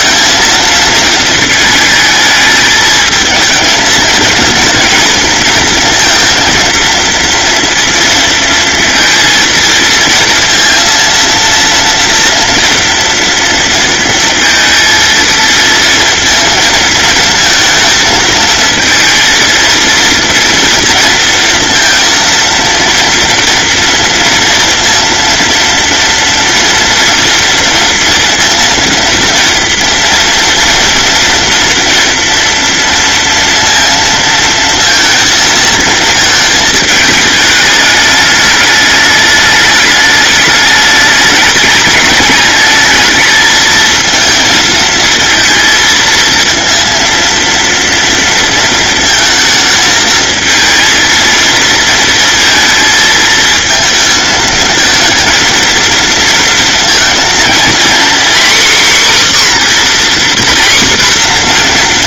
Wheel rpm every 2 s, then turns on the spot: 220, 220, 230, 230, 230, 230, 230, 230, 220, 220, 230, 230, 230, 230, 230, 230, 230, 230, 210, 210, 210, 210, 220, 230, 230, 220, 230, 220, 230, 260, 250.
none